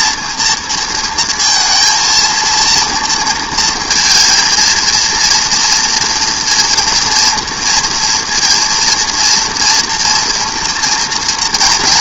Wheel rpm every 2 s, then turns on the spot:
230, 220, 230, 230, 230, 230.
none